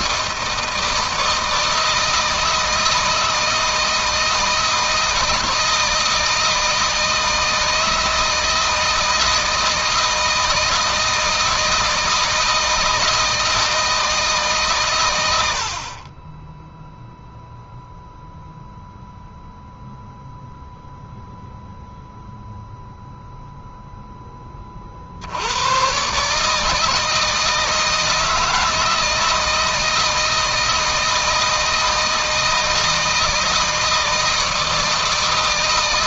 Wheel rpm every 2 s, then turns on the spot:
160, 160, 160, 160, 160, 160, 160, 140, 10, 0, 0, 0, 30, 150, 160, 160, 160, 160.
none